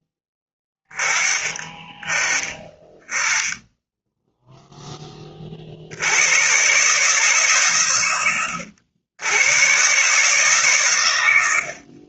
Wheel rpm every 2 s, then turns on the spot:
10, 10, 10, 140, 90, 130.
none